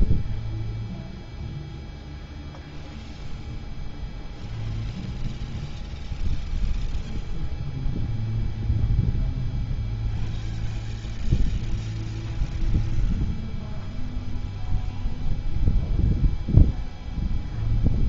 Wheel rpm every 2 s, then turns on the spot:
0, 0, 0, 0, 0, 0, 0, 0, 0.
none